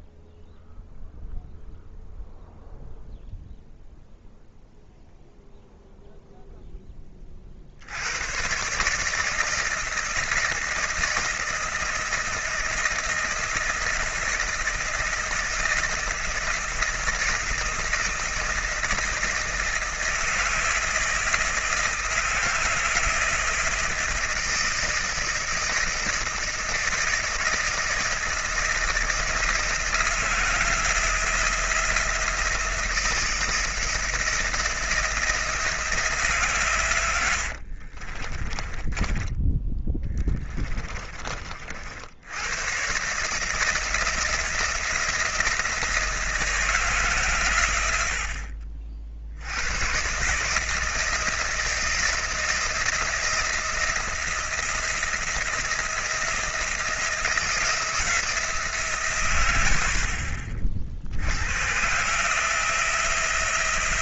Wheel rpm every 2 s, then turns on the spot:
0, 0, 0, 10, 140, 160, 160, 160, 160, 160, 160, 170, 160, 160, 160, 170, 170, 170, 130, 30, 30, 130, 160, 150, 60, 160, 170, 170, 170, 150, 60, 170.
38-42